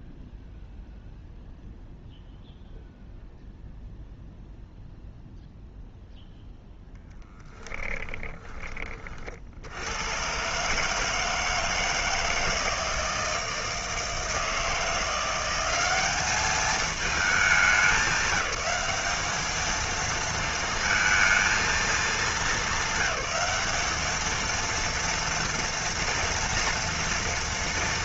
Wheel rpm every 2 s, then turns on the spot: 0, 0, 0, 0, 30, 140, 160, 160, 210, 210, 230, 200, 230, 230.
none